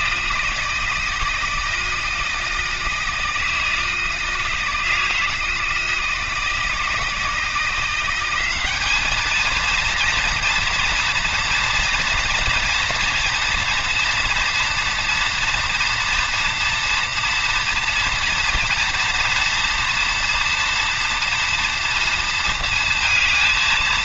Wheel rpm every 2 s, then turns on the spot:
160, 160, 160, 160, 180, 230, 240, 240, 230, 230, 230, 230.
none